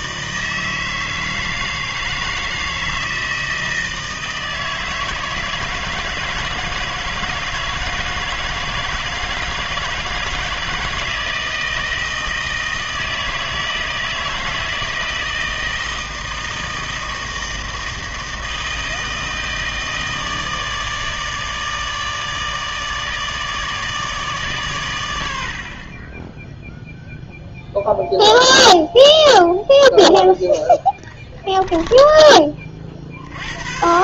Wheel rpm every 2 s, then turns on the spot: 160, 160, 160, 160, 160, 160, 160, 160, 160, 160, 160, 160, 130, 0, 0, 0, 40.
none